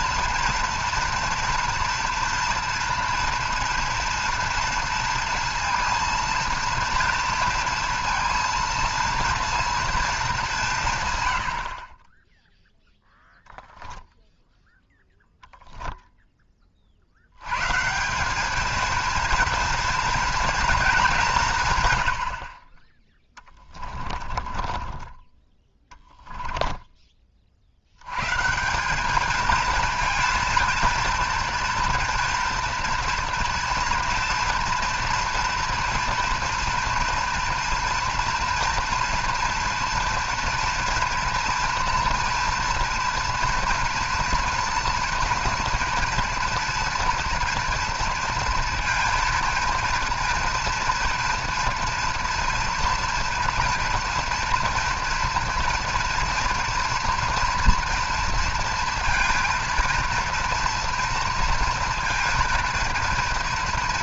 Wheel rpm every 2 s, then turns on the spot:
240, 230, 230, 230, 230, 170, 0, 0, 30, 220, 220, 40, 30, 10, 170, 230, 230, 230, 230, 230, 230, 230, 230, 230, 230, 240, 230, 230, 230, 230, 230, 230.
24-28